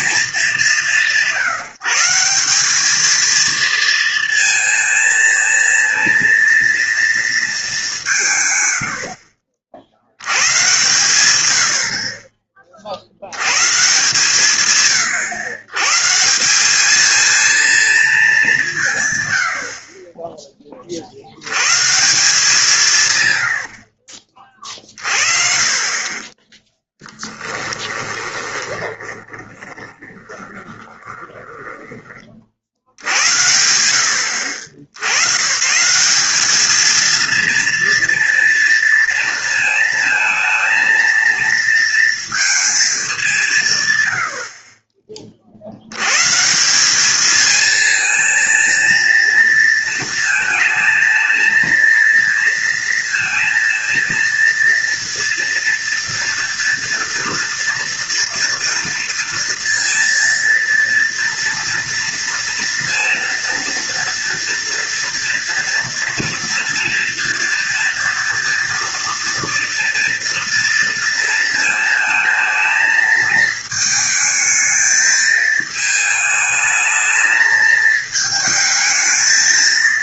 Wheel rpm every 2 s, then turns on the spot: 170, 210, 230, 230, 90, 120, 40, 120, 210, 160, 40, 160, 30, 10, 20, 20, 70, 90, 220, 230, 230, 210, 40, 190, 230, 220, 230, 230, 230, 240, 230, 230, 230, 230, 230, 230, 220, 220, 220, 220.
8-10 28-32